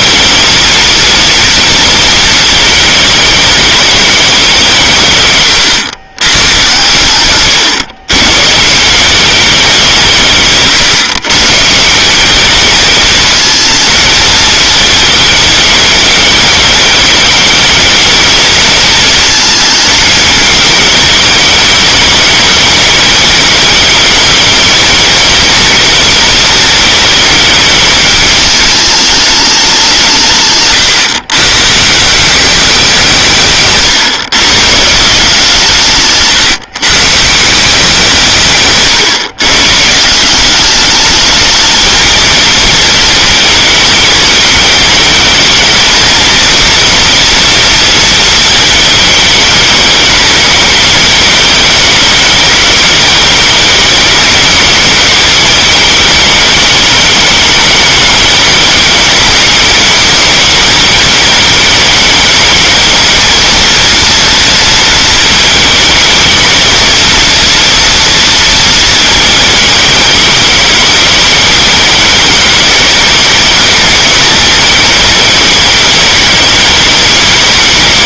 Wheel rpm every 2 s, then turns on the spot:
230, 220, 180, 110, 130, 150, 220, 220, 210, 220, 210, 200, 220, 220, 210, 140, 190, 130, 150, 150, 190, 230, 210, 230, 230, 210, 200, 210, 220, 220, 210, 210, 230, 220, 230, 220, 220, 220, 210.
30-32